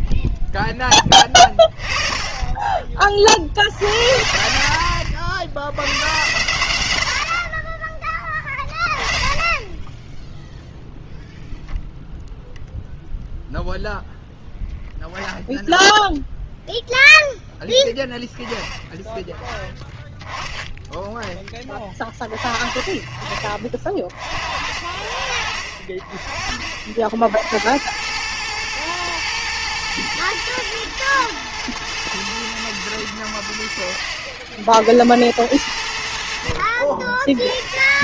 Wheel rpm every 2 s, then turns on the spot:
10, 20, 70, 100, 30, 0, 0, 0, 0, 10, 10, 30, 50, 50, 110, 110, 110, 60, 60.
4-6